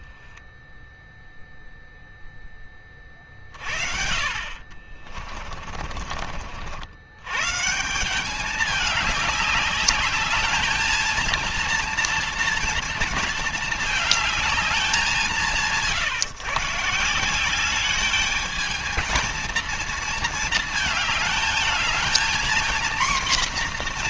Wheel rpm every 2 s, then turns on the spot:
0, 20, 40, 90, 200, 220, 230, 190, 150, 220, 220, 240.
4-6